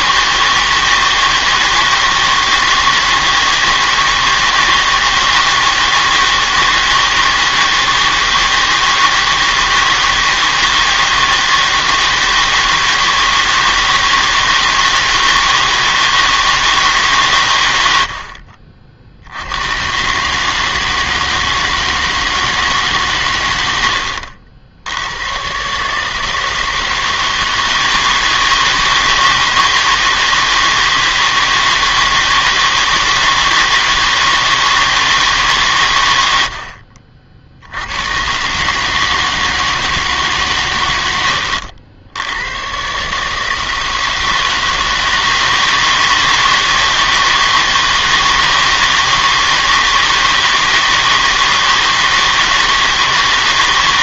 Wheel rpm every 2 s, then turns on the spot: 160, 160, 160, 160, 160, 160, 160, 160, 160, 40, 150, 150, 70, 160, 160, 160, 160, 160, 60, 150, 120, 100, 160, 160, 160, 160, 160.
18-20